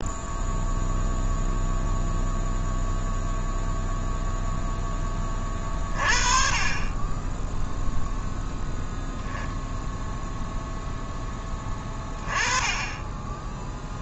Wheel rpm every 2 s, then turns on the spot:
0, 0, 0, 30, 0, 0, 20.
none